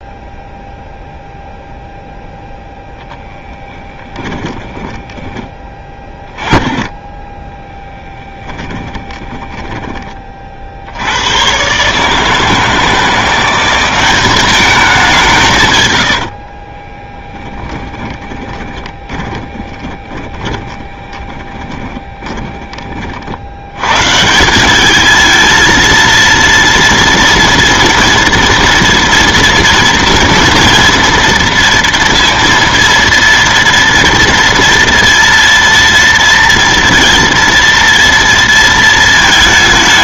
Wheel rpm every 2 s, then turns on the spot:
0, 0, 10, 20, 10, 50, 160, 200, 50, 20, 20, 30, 190, 230, 230, 240, 230, 230, 230, 230.
4-6 8-10 16-24